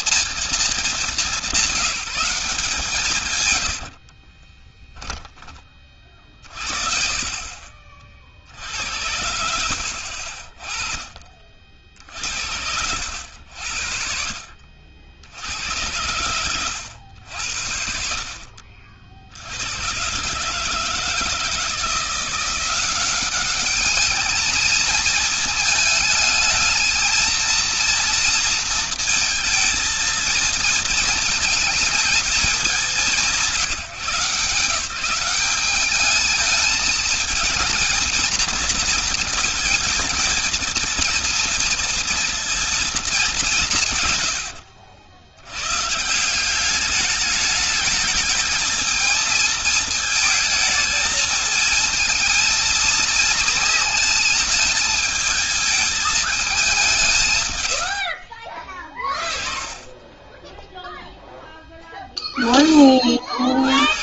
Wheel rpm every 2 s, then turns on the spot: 210, 170, 10, 50, 70, 30, 70, 70, 90, 60, 160, 190, 220, 220, 230, 220, 200, 180, 220, 230, 220, 230, 90, 200, 220, 220, 230, 220, 180, 30, 10, 40.
4-6